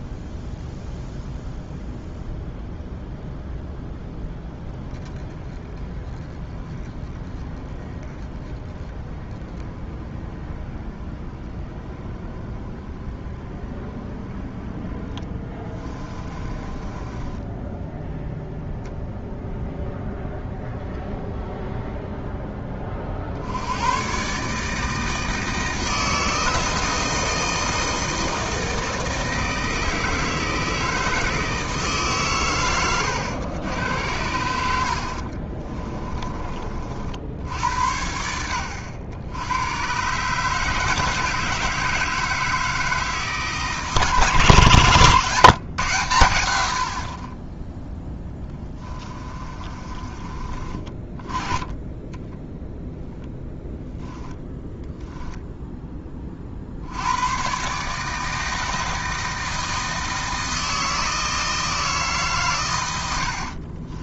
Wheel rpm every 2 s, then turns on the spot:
0, 0, 10, 10, 10, 20, 20, 10, 20, 0, 0, 30, 160, 160, 160, 160, 120, 70, 50, 100, 160, 160, 130, 60, 20, 30, 0, 10, 70, 160, 160, 90.
16-18 48-50